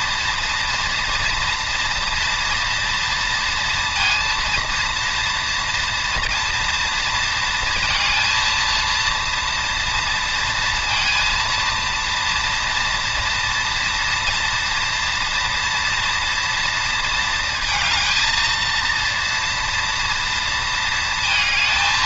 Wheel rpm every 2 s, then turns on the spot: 230, 230, 230, 230, 230, 230, 230, 240, 230, 230, 230.
none